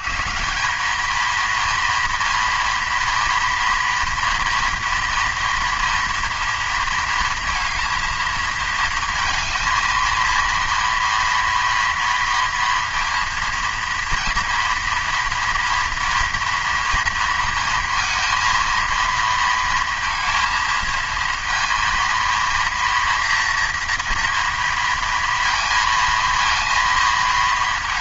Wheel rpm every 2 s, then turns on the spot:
180, 230, 230, 230, 220, 240, 230, 230, 230, 230, 220, 230, 230, 230.
none